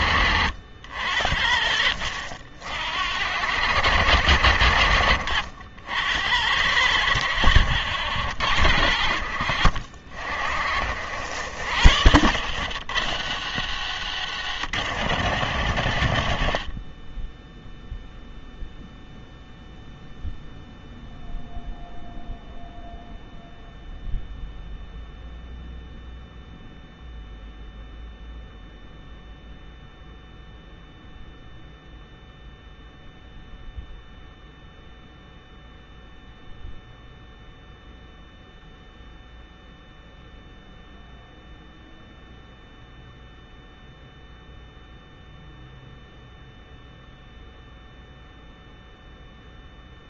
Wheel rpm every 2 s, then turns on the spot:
70, 70, 80, 80, 80, 60, 100, 100, 30, 0, 0, 0, 0, 0, 0, 0, 0, 0, 0, 0, 0, 0, 0, 0, 0.
12-14